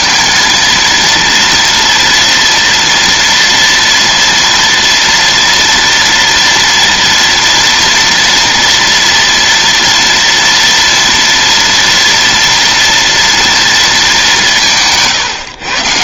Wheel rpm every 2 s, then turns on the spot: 230, 230, 230, 230, 240, 230, 230, 180.
14-16